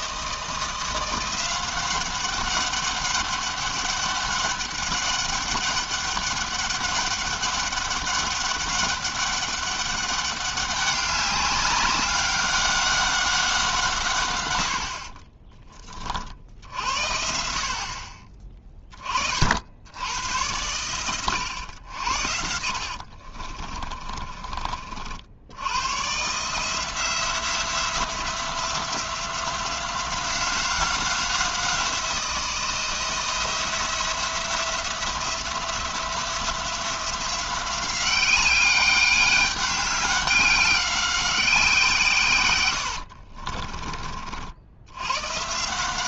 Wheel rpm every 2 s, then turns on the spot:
170, 200, 200, 200, 200, 200, 190, 100, 60, 20, 110, 70, 40, 160, 170, 190, 170, 170, 180, 190, 190, 100, 70.
22-24 42-44